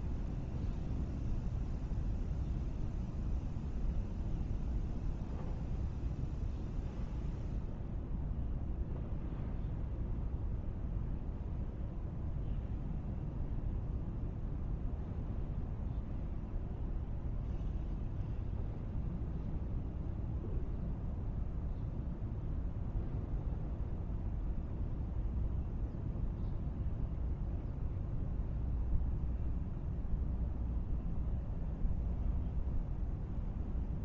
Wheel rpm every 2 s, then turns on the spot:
0, 0, 0, 0, 0, 0, 0, 0, 0, 0, 0, 0, 0, 0, 0, 0, 0.
none